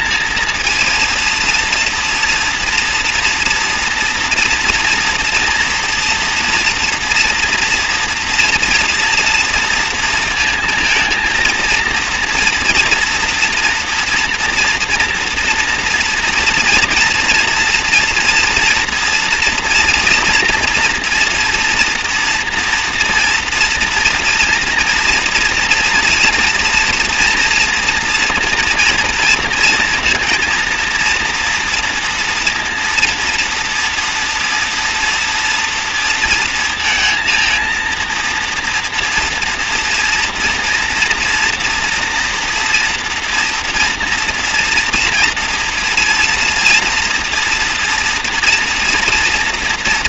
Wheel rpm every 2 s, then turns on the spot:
230, 230, 230, 230, 240, 230, 230, 230, 230, 240, 240, 230, 230, 230, 230, 230, 230, 230, 230, 230, 230, 230, 230, 230, 240.
none